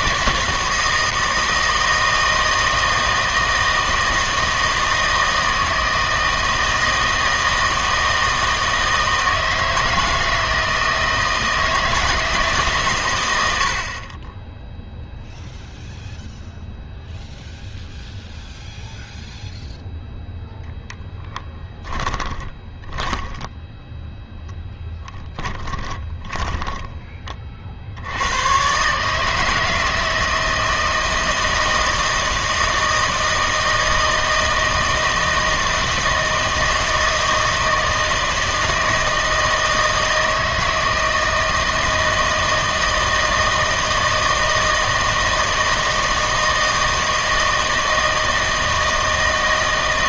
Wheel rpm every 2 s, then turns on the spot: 160, 160, 160, 160, 160, 160, 150, 10, 0, 0, 10, 20, 10, 10, 120, 160, 160, 160, 160, 160, 160, 160, 160, 160, 160.
22-28